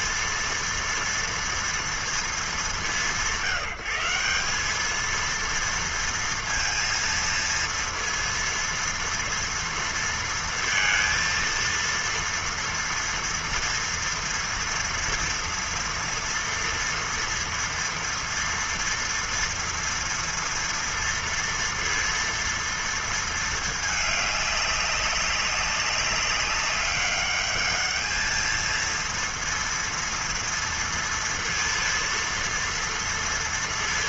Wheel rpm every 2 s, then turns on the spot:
230, 190, 200, 230, 230, 230, 230, 230, 230, 230, 230, 230, 200, 200, 220, 230, 230.
none